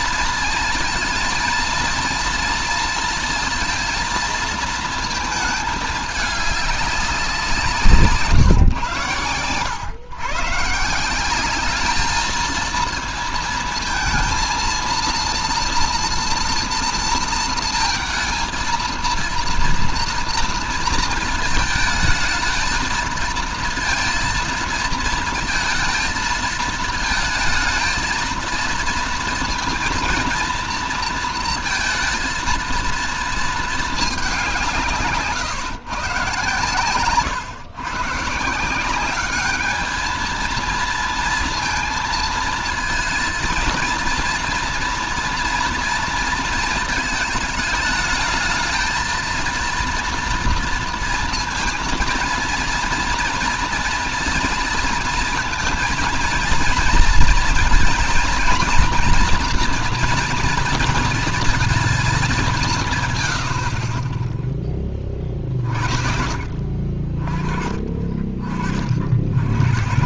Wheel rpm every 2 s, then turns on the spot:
230, 230, 220, 200, 120, 160, 220, 230, 230, 230, 230, 220, 230, 220, 230, 230, 230, 160, 130, 180, 230, 230, 230, 220, 220, 230, 230, 230, 220, 230, 230, 160, 20, 30, 50.
none